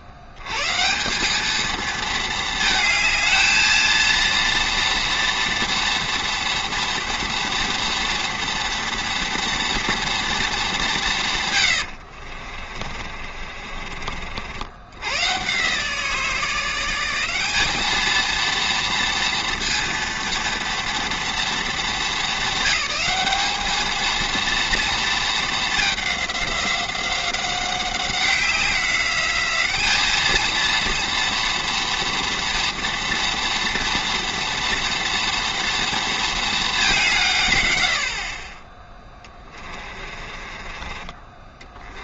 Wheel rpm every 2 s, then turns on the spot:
80, 220, 230, 230, 230, 200, 40, 70, 170, 230, 230, 220, 230, 190, 190, 220, 230, 240, 220, 30, 30.
12-14 40-42